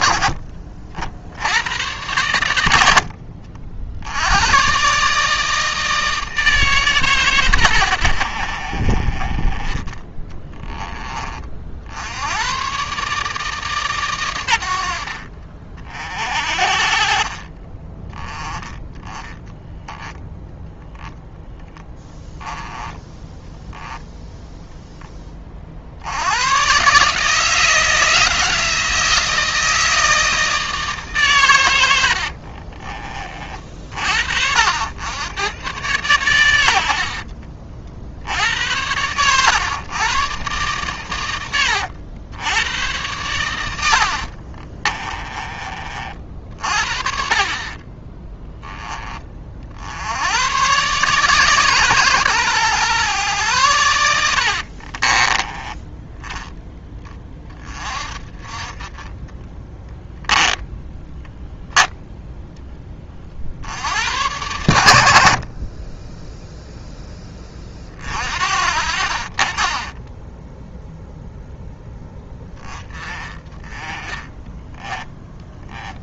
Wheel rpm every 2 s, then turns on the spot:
70, 90, 120, 160, 80, 20, 120, 90, 40, 10, 10, 10, 0, 120, 160, 160, 40, 70, 90, 100, 140, 100, 40, 50, 10, 120, 110, 60, 10, 30, 10, 10, 90, 0, 60, 10, 10, 10.
10-12 22-24 32-34 44-46 54-56 60-62 74-76